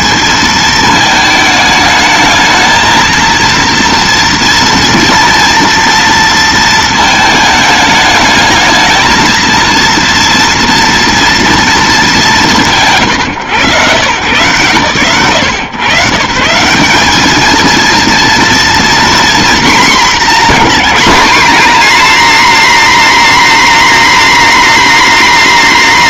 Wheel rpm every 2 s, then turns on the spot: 220, 220, 230, 230, 220, 230, 150, 120, 200, 240, 220, 260, 260.
none